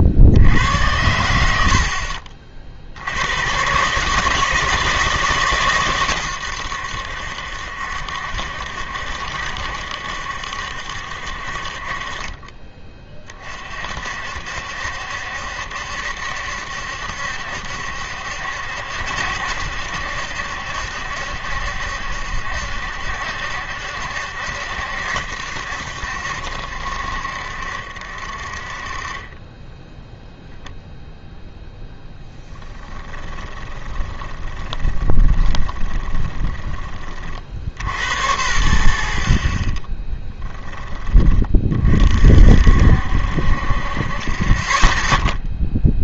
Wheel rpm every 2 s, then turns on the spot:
90, 60, 160, 90, 70, 70, 30, 60, 70, 70, 70, 70, 70, 60, 30, 0, 10, 20, 20, 90, 20, 60, 20.
32-38